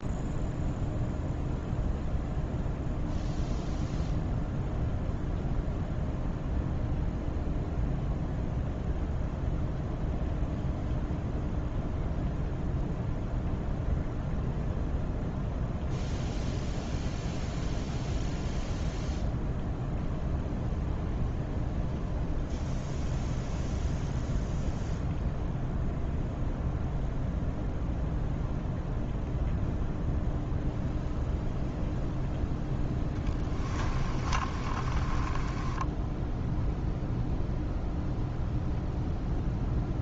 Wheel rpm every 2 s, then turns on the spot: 0, 0, 0, 0, 0, 0, 0, 0, 0, 0, 0, 0, 0, 0, 0, 0, 10, 30, 0, 0.
32-36